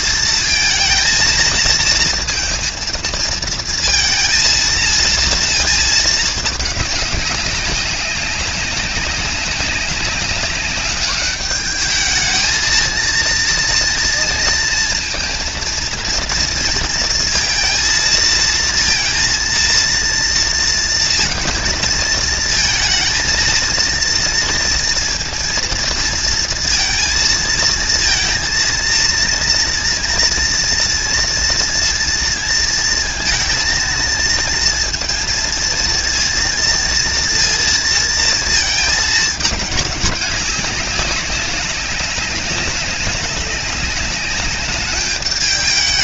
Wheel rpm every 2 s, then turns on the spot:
230, 220, 220, 210, 190, 200, 230, 230, 230, 230, 230, 230, 230, 230, 230, 230, 230, 230, 230, 220, 200, 200, 210.
none